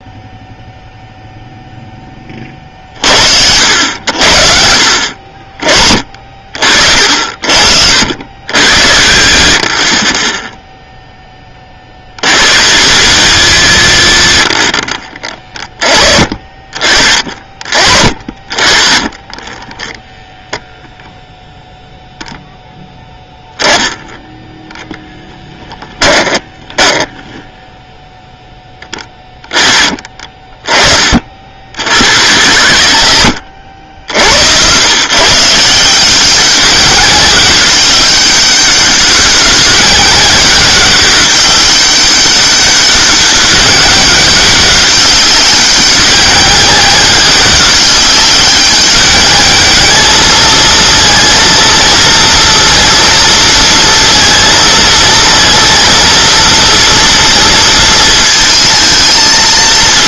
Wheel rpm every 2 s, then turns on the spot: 0, 40, 60, 40, 80, 0, 100, 40, 40, 40, 0, 0, 0, 20, 10, 20, 110, 100, 190, 200, 200, 200, 190, 200, 200, 220, 230, 230, 230, 220.
26-28